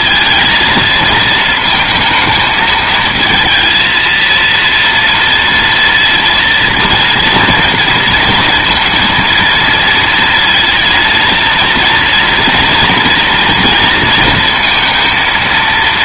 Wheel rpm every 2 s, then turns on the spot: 220, 220, 230, 230, 230, 230, 240, 230.
none